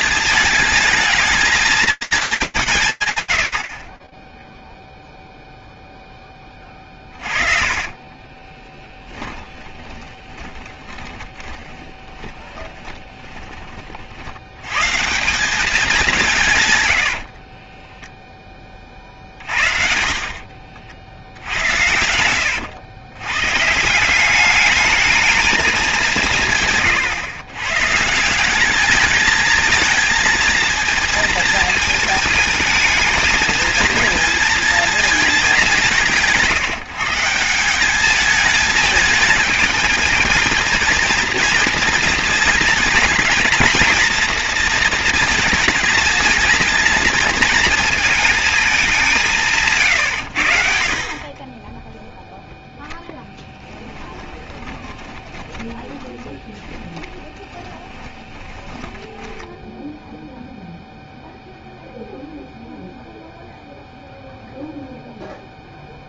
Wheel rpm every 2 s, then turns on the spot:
220, 200, 0, 10, 20, 20, 20, 150, 90, 40, 60, 100, 210, 140, 210, 230, 220, 230, 160, 210, 220, 230, 230, 230, 200, 40, 10, 20, 20, 20, 0, 0, 0.
6-14 16-18 54-60